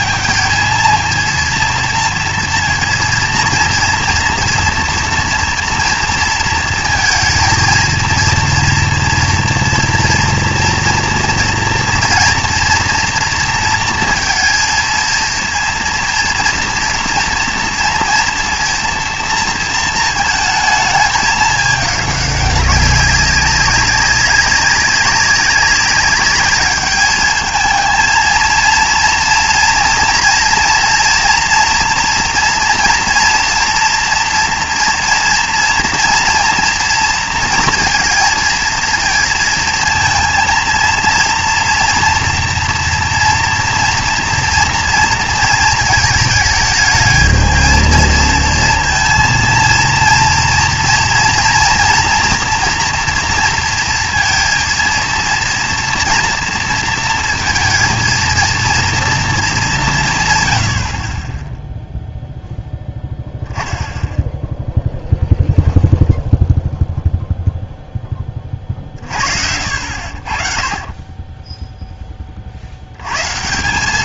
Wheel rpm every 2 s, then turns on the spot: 230, 230, 230, 230, 230, 230, 240, 230, 230, 230, 220, 200, 190, 210, 230, 240, 230, 240, 230, 230, 230, 240, 230, 220, 230, 230, 240, 230, 230, 230, 90, 0, 0, 0, 40, 30, 70.
none